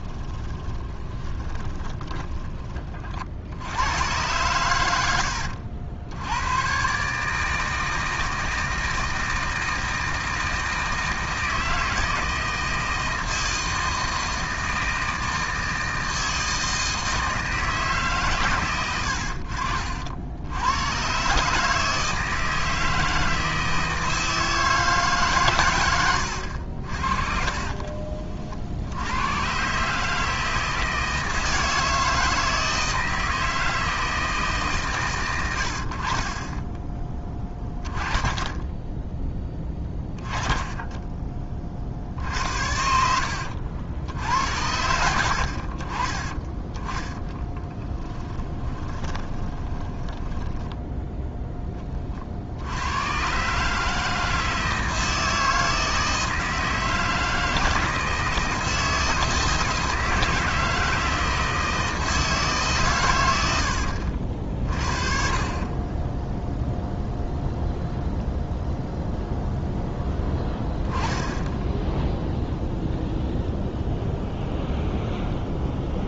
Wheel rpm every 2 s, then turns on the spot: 20, 40, 110, 120, 160, 160, 160, 160, 160, 120, 90, 160, 160, 60, 60, 160, 160, 140, 20, 10, 10, 70, 80, 10, 20, 10, 80, 160, 160, 160, 160, 140, 40, 0, 0, 10, 0, 0.
0-2 18-20 42-44 48-52